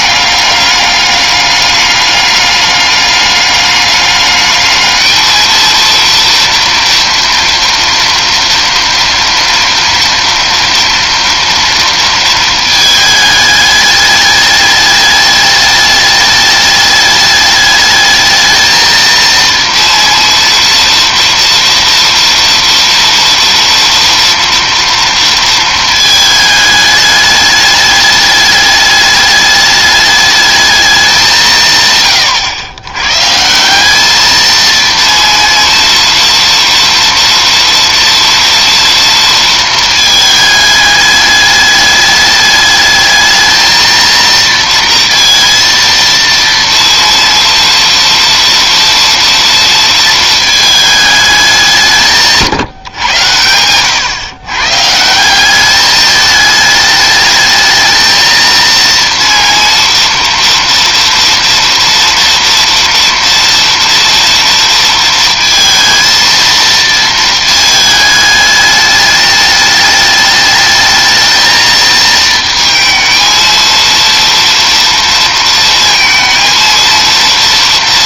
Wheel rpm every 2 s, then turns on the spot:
200, 200, 210, 230, 230, 230, 230, 210, 210, 220, 230, 230, 230, 220, 210, 210, 120, 220, 230, 230, 220, 210, 230, 230, 230, 220, 160, 120, 210, 230, 230, 230, 230, 230, 210, 210, 220, 230, 230.
none